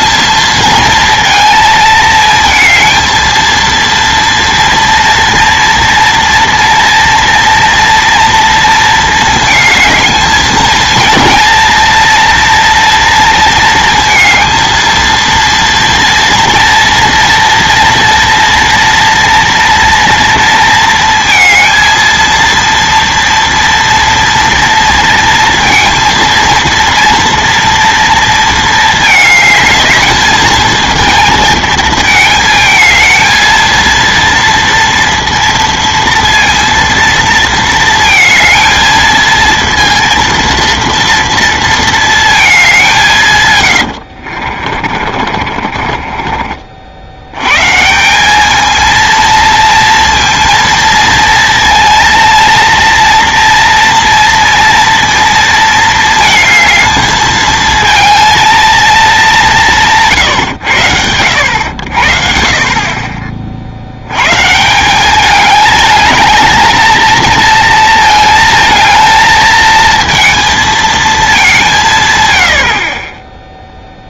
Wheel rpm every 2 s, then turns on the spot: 220, 230, 230, 230, 230, 230, 230, 230, 230, 230, 230, 230, 230, 230, 220, 220, 220, 230, 230, 220, 230, 200, 40, 50, 220, 230, 230, 230, 220, 230, 110, 50, 140, 220, 220, 230, 60.
44-46